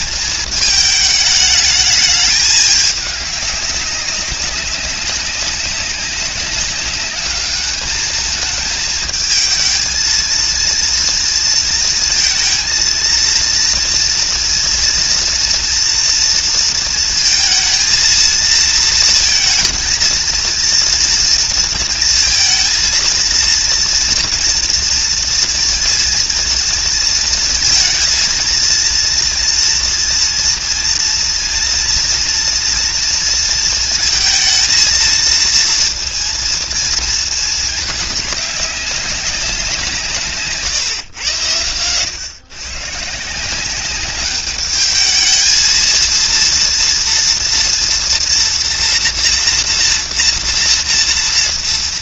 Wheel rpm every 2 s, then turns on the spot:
220, 210, 200, 190, 220, 230, 230, 240, 230, 230, 230, 230, 230, 230, 230, 230, 230, 230, 230, 200, 150, 120, 210, 230, 240, 230.
none